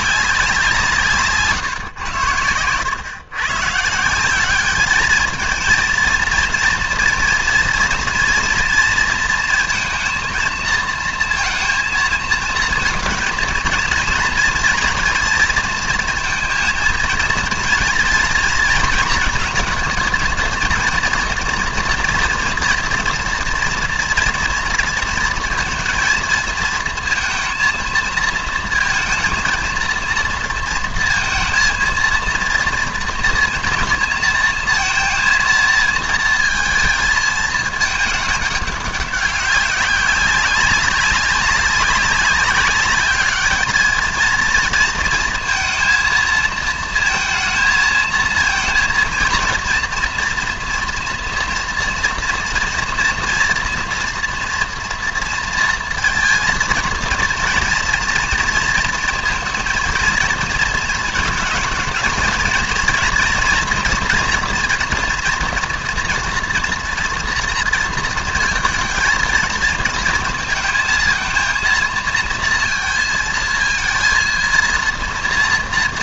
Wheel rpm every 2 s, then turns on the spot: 170, 100, 200, 230, 230, 230, 220, 230, 230, 230, 230, 240, 230, 230, 230, 230, 230, 230, 220, 210, 190, 200, 230, 220, 230, 230, 230, 240, 230, 230, 220, 230, 240, 230, 230, 230, 230, 230.
none